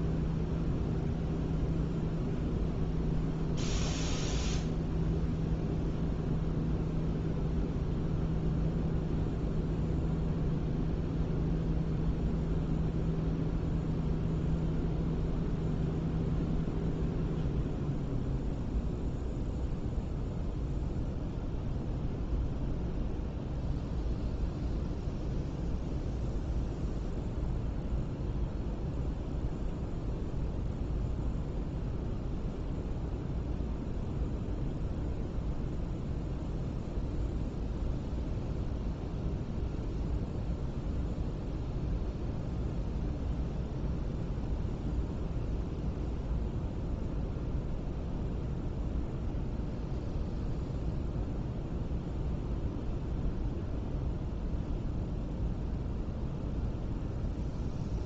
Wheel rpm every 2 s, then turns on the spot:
0, 0, 0, 0, 0, 0, 0, 0, 0, 0, 0, 0, 0, 0, 0, 0, 0, 0, 0, 0, 0, 0, 0, 0, 0, 0, 0, 0, 0.
none